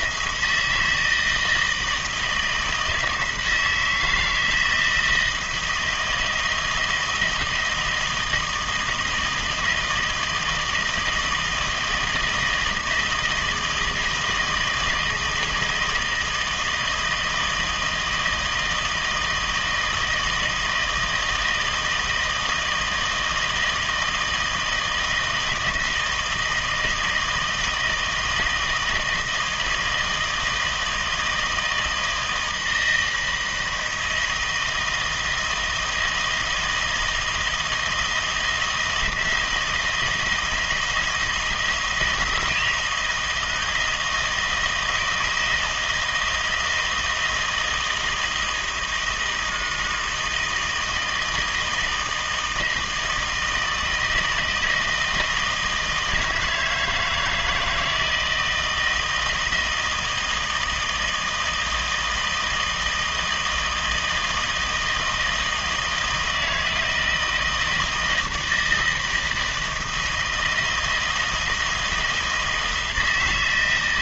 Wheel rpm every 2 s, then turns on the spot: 160, 160, 160, 160, 160, 160, 160, 160, 160, 160, 160, 160, 160, 160, 160, 160, 160, 160, 160, 170, 160, 170, 170, 160, 160, 160, 160, 160, 160, 160, 160, 160, 160, 160, 160, 160, 160.
none